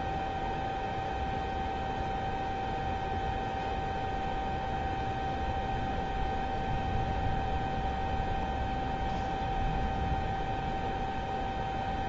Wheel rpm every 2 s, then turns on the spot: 0, 0, 0, 0, 0, 0.
none